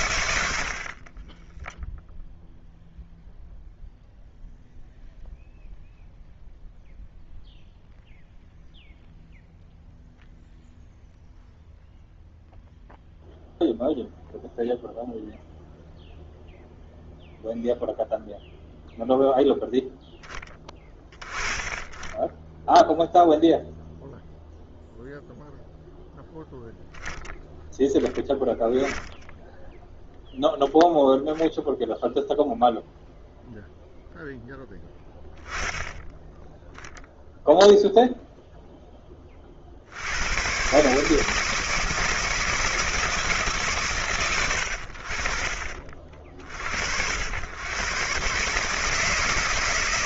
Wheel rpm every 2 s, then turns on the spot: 50, 0, 0, 0, 0, 0, 0, 0, 0, 0, 10, 10, 0, 10, 10, 0, 0, 10, 0, 0, 130, 160, 80, 50, 150.
none